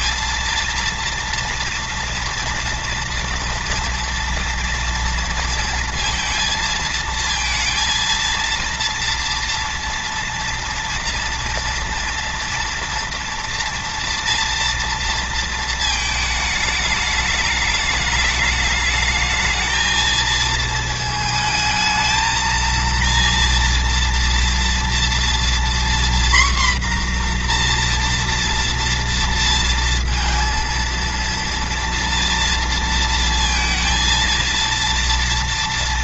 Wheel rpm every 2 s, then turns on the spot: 230, 230, 230, 230, 230, 230, 230, 230, 210, 210, 220, 230, 230, 250, 230, 230, 230, 230.
none